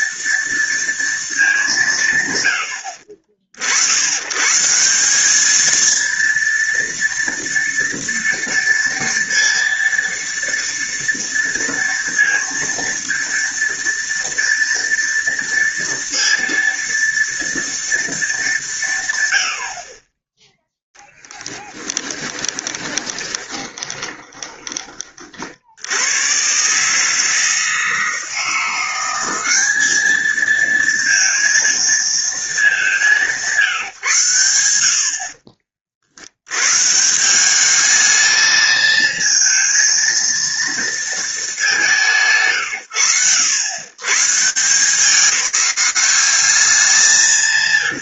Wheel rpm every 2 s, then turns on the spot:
230, 70, 170, 230, 230, 230, 230, 230, 230, 170, 10, 20, 30, 140, 180, 230, 190, 70, 140, 220, 230, 130, 170, 190.
22-24